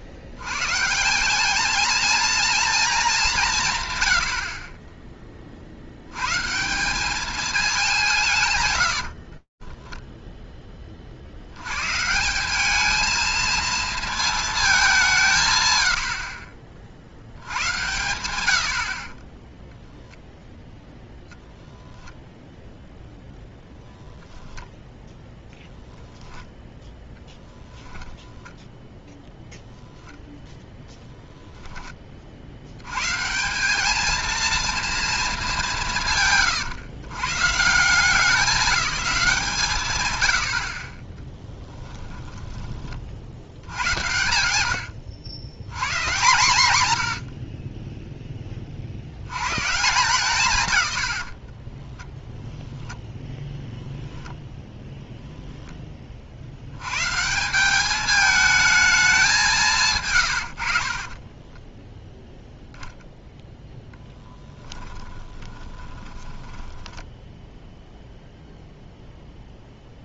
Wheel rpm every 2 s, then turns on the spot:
140, 230, 50, 160, 120, 10, 110, 230, 100, 110, 0, 0, 0, 10, 0, 0, 40, 230, 140, 190, 70, 20, 90, 130, 30, 140, 0, 0, 80, 220, 100, 0, 10, 10, 0.
8-12 60-62 64-68